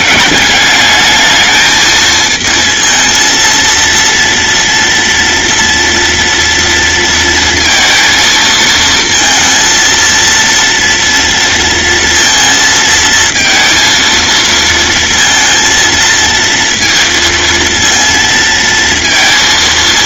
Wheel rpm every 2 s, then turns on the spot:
200, 220, 230, 230, 220, 230, 230, 230, 230, 230.
none